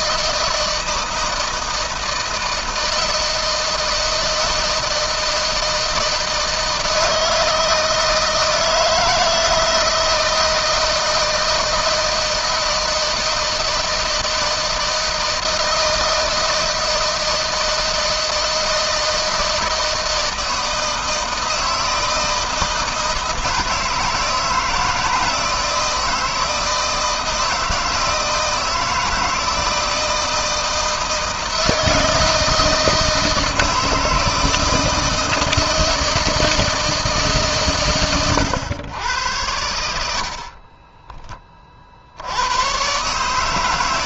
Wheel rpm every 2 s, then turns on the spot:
160, 160, 160, 160, 160, 160, 160, 160, 160, 160, 160, 160, 160, 160, 160, 160, 160, 160, 150, 100, 20, 140.
none